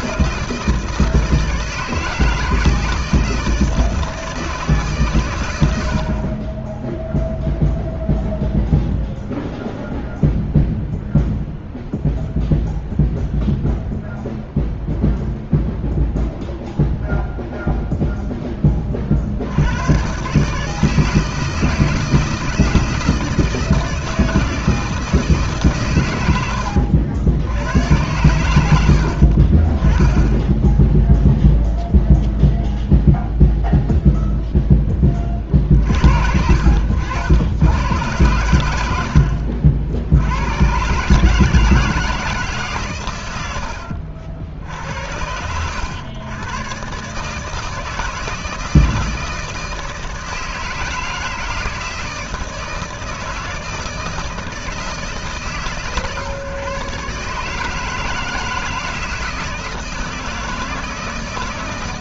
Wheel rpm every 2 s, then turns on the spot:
160, 160, 140, 0, 0, 0, 0, 0, 0, 40, 160, 160, 160, 70, 60, 10, 0, 10, 90, 80, 130, 130, 70, 130, 160, 160, 160, 150, 140, 160, 160.
36-38